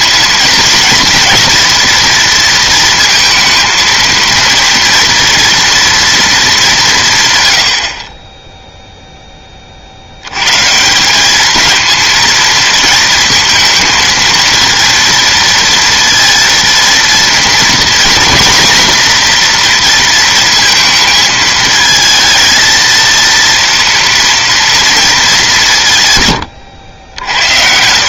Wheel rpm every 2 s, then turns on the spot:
230, 230, 230, 200, 0, 150, 230, 230, 230, 240, 220, 230, 230, 90.
none